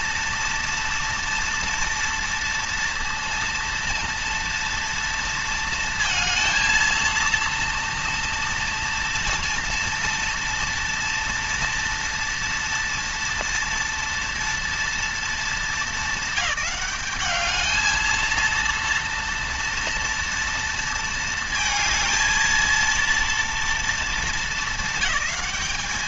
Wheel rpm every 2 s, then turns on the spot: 230, 230, 230, 230, 230, 230, 230, 230, 210, 230, 230, 230, 220.
none